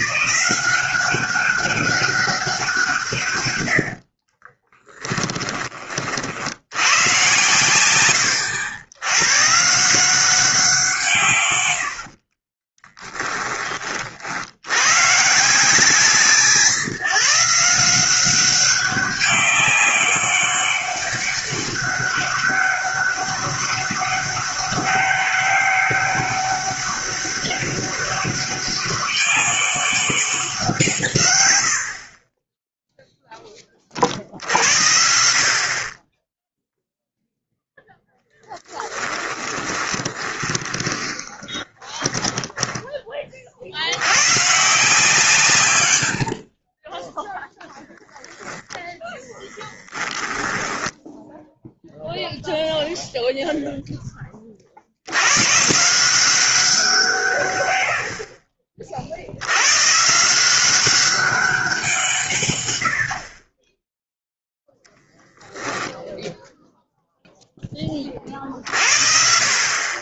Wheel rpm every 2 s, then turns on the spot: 190, 170, 10, 100, 100, 170, 20, 100, 150, 200, 200, 200, 200, 200, 200, 170, 10, 60, 0, 10, 20, 20, 150, 30, 10, 10, 0, 60, 170, 40, 190, 110, 0, 0, 40.
4-6 12-14 38-42 46-52